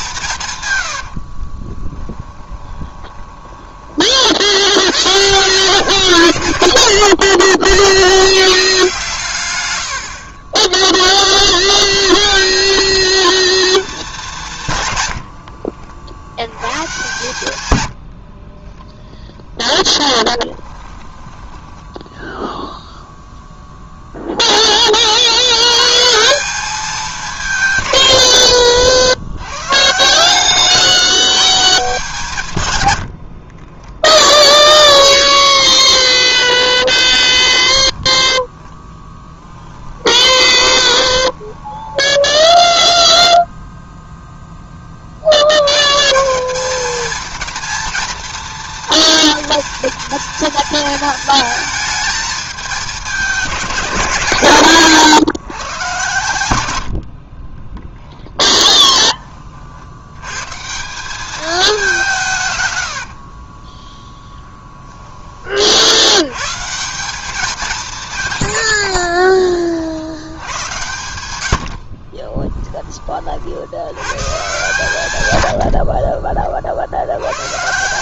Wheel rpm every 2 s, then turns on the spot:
110, 20, 80, 60, 140, 20, 200, 120, 120, 20, 10, 0, 20, 190, 80, 150, 110, 10, 10, 10, 20, 0, 20, 220, 230, 230, 210, 130, 80, 30, 170, 110, 10, 160, 70, 90, 20, 110, 60.
0-4 6-8 18-22 40-42 58-60 62-64 68-70